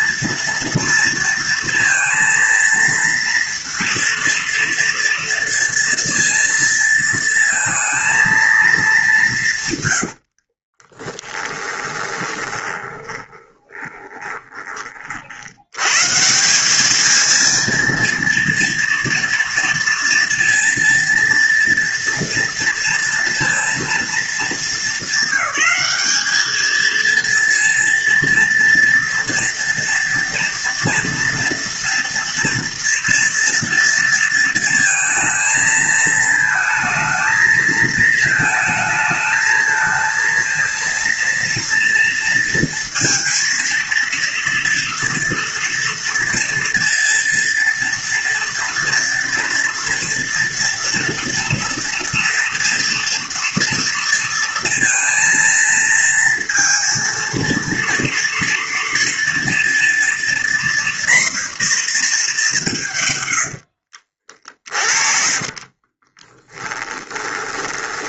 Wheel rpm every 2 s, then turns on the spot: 230, 230, 230, 230, 170, 20, 20, 50, 220, 240, 230, 230, 200, 230, 230, 230, 230, 230, 220, 220, 230, 230, 230, 230, 230, 230, 230, 230, 230, 230, 240, 110, 30, 20.
10-14 62-68